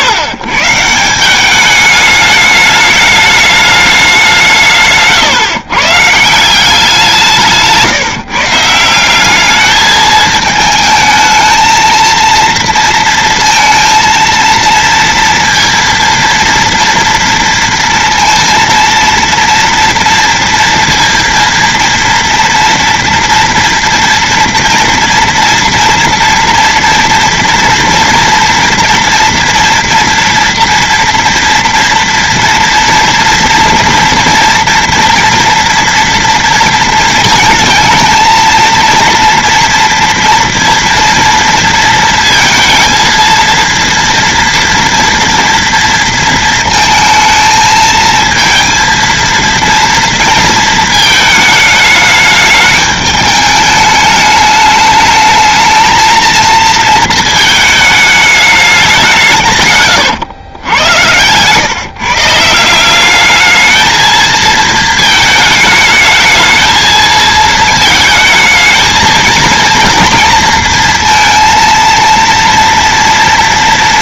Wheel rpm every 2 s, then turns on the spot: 130, 210, 150, 170, 160, 220, 230, 230, 230, 230, 230, 240, 230, 230, 230, 230, 230, 230, 230, 230, 240, 230, 230, 230, 230, 230, 210, 210, 230, 200, 100, 170, 220, 220, 220, 230, 230.
none